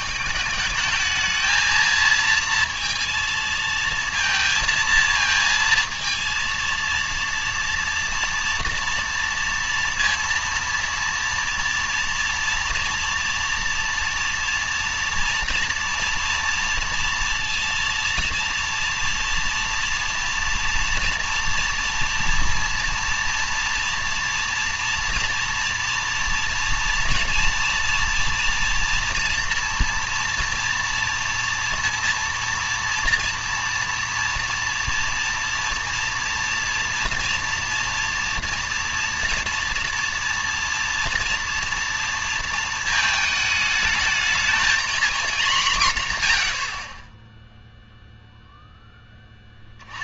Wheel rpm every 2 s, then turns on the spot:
210, 230, 230, 230, 230, 230, 230, 230, 230, 230, 230, 230, 230, 240, 230, 230, 230, 230, 230, 230, 230, 220, 230, 60, 0.
none